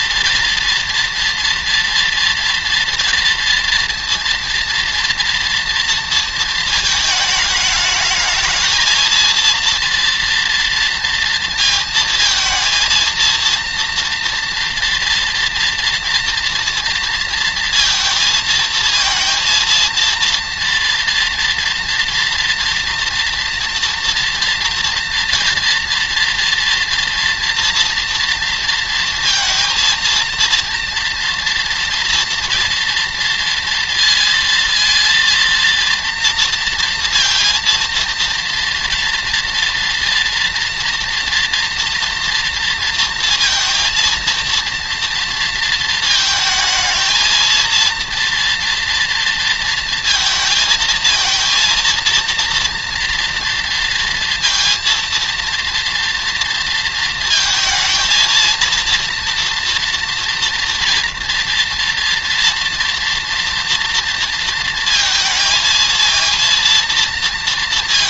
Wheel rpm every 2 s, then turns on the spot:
230, 230, 230, 220, 230, 230, 230, 230, 230, 220, 240, 230, 230, 230, 230, 230, 230, 230, 230, 230, 230, 230, 230, 220, 230, 230, 230, 230, 230, 230, 230, 230, 230, 230.
none